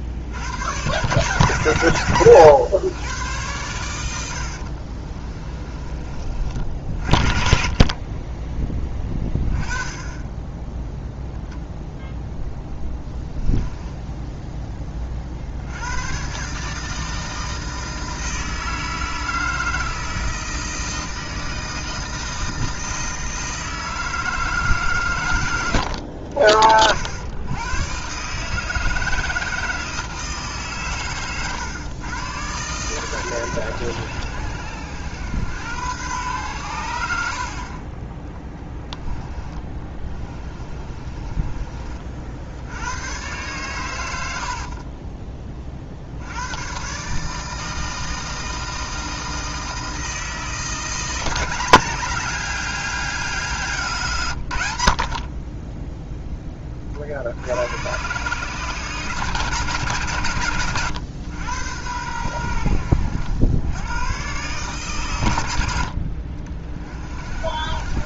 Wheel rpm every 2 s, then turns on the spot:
110, 120, 50, 50, 10, 10, 10, 20, 150, 160, 160, 160, 150, 80, 160, 140, 120, 100, 100, 10, 20, 80, 50, 120, 160, 170, 200, 80, 40, 150, 120, 90, 130, 60.
4-6 12-14 38-42 44-46